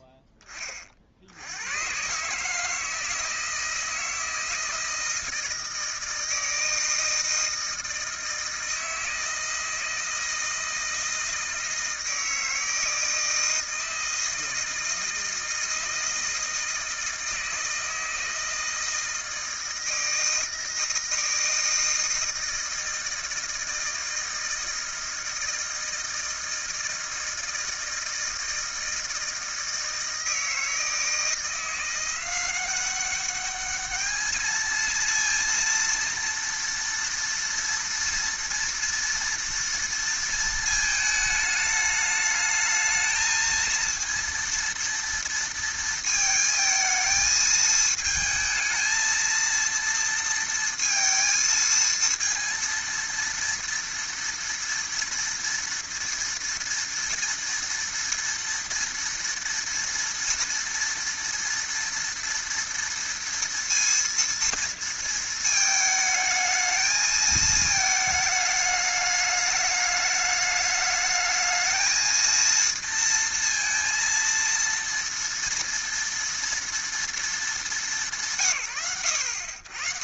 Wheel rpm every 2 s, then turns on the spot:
40, 160, 160, 160, 160, 160, 160, 160, 160, 160, 160, 160, 160, 160, 160, 160, 190, 220, 230, 230, 220, 220, 230, 220, 220, 230, 230, 230, 230, 230, 230, 230, 230, 220, 210, 210, 230, 230, 230, 60.
none